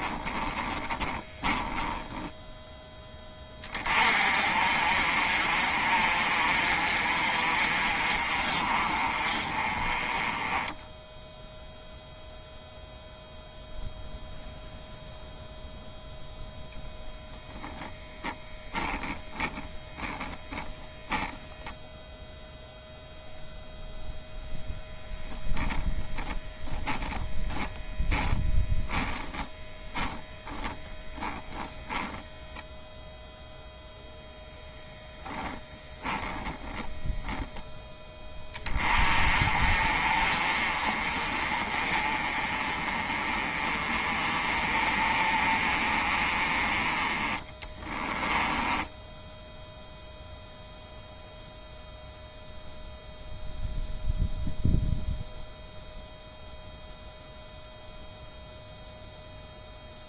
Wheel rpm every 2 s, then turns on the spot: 20, 10, 40, 40, 40, 10, 0, 0, 0, 10, 10, 0, 0, 0, 10, 10, 0, 0, 10, 30, 40, 30, 40, 30, 10, 0, 0, 0, 0, 0.
0-2 36-38 48-50